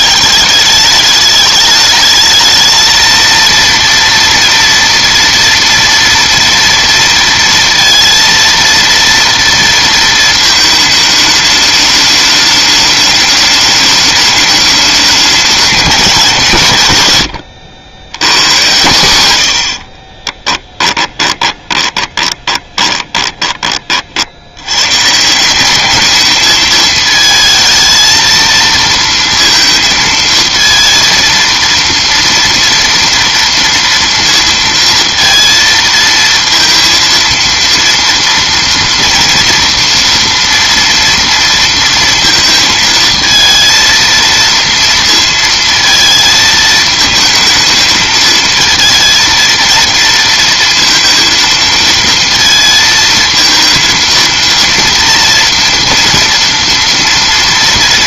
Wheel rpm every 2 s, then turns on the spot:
210, 220, 230, 230, 230, 220, 210, 210, 150, 130, 10, 20, 100, 220, 230, 230, 230, 230, 230, 230, 230, 220, 230, 220, 220, 230, 230, 230, 230.
20-24